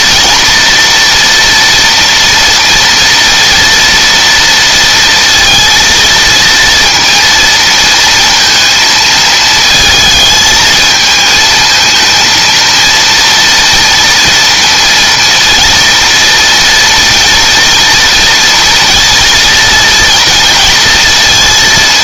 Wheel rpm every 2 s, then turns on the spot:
240, 230, 230, 230, 220, 220, 230, 230, 230, 230, 230.
none